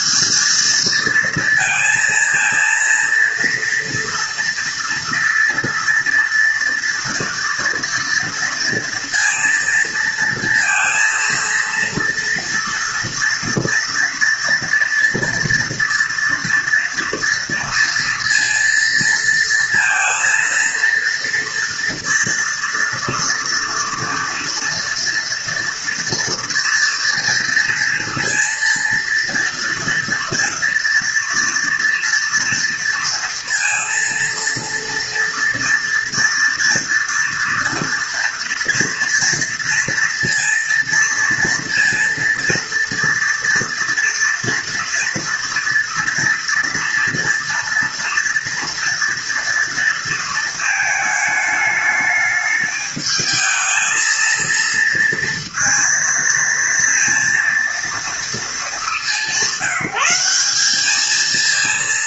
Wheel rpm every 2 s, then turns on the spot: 230, 230, 230, 240, 230, 230, 240, 230, 230, 230, 240, 230, 230, 230, 230, 230, 230, 240, 230, 230, 240, 230, 230, 230, 230, 220, 220, 230, 230, 190, 220.
none